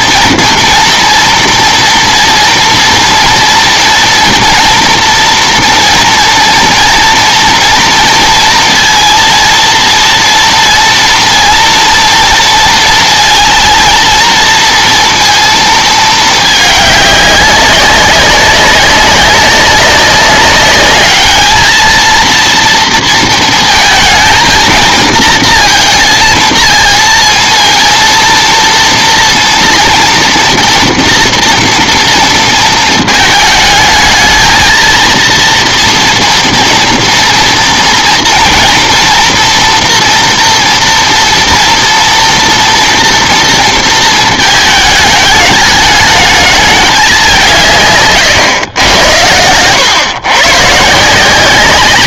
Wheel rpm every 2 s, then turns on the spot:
240, 230, 230, 230, 230, 230, 230, 230, 210, 200, 200, 230, 230, 230, 230, 230, 230, 220, 230, 240, 230, 230, 220, 210, 120, 140.
none